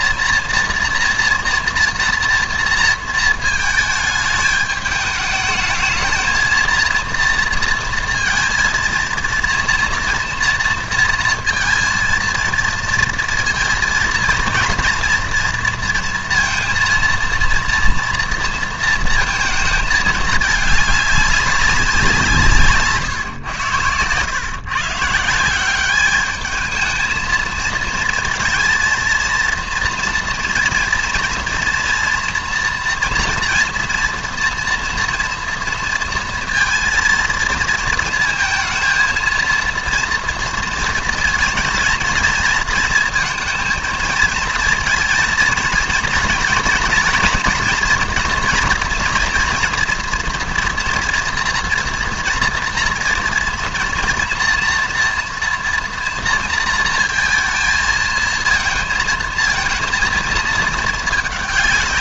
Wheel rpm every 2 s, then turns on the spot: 240, 230, 210, 230, 230, 230, 230, 230, 230, 230, 210, 160, 140, 220, 230, 230, 240, 230, 230, 230, 230, 230, 230, 230, 240, 230, 230, 240, 230, 220, 220.
none